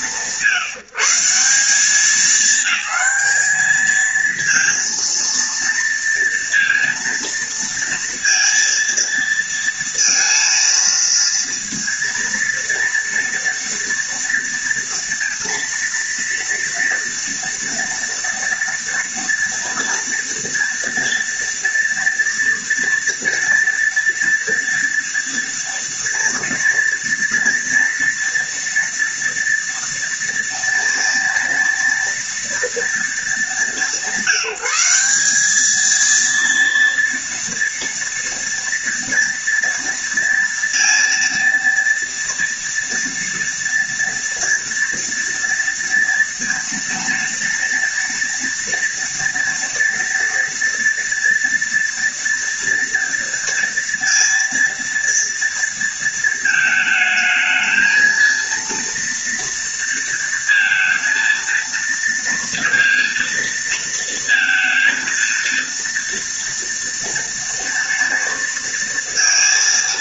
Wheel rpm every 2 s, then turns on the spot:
160, 210, 230, 230, 230, 230, 230, 230, 240, 230, 230, 230, 230, 230, 230, 230, 220, 190, 230, 230, 230, 230, 230, 230, 230, 230, 240, 230, 220, 230, 230, 230, 230, 230, 230.
none